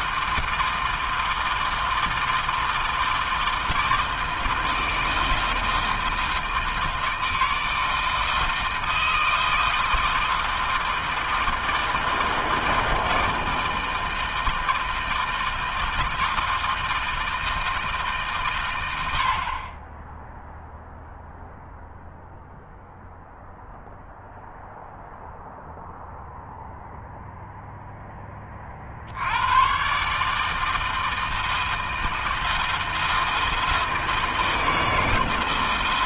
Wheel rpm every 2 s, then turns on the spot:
160, 160, 160, 160, 160, 160, 160, 160, 160, 140, 0, 0, 0, 0, 20, 150, 160, 160.
none